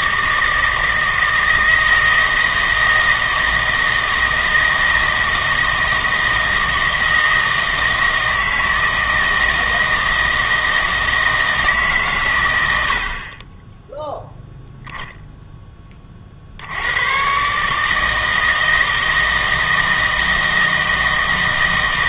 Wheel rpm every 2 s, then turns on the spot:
160, 160, 160, 160, 160, 160, 90, 0, 80, 160, 160.
none